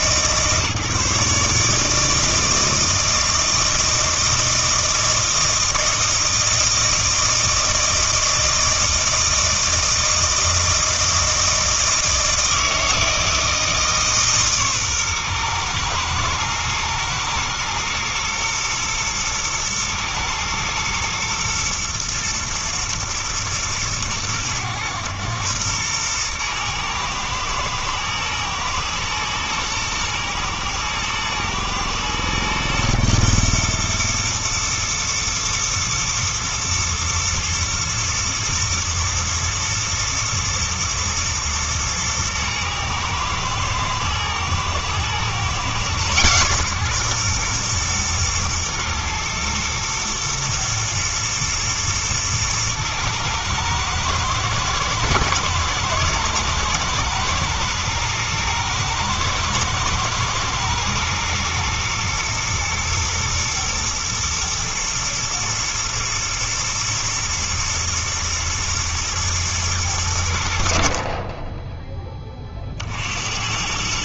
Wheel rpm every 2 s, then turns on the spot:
150, 160, 160, 160, 160, 160, 160, 140, 110, 120, 110, 120, 110, 120, 120, 110, 120, 110, 110, 110, 120, 110, 110, 130, 120, 120, 110, 110, 110, 110, 110, 110, 110, 110, 110, 70, 50.
none